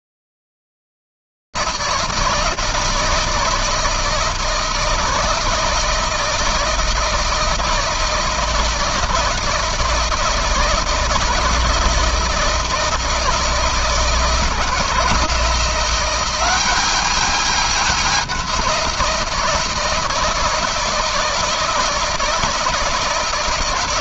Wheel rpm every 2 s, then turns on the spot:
160, 160, 160, 160, 160, 160, 160, 160, 170, 200, 170, 160.
none